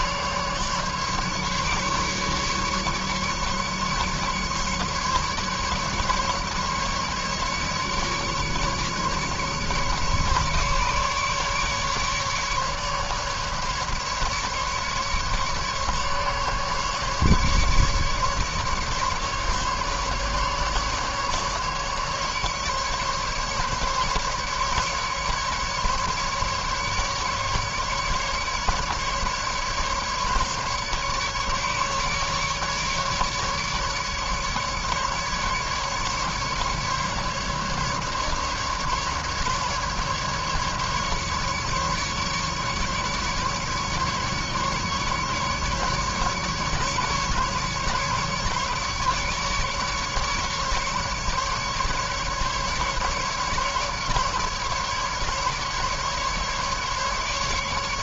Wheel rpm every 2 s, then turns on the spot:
140, 150, 140, 150, 150, 150, 150, 150, 140, 150, 150, 150, 150, 150, 150, 150, 150, 150, 150, 150, 140, 140, 140, 140, 150, 140, 150, 140, 150.
none